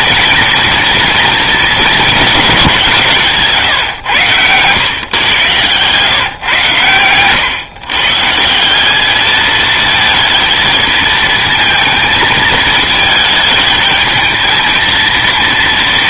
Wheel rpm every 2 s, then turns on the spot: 230, 170, 120, 110, 210, 220, 220, 230.
none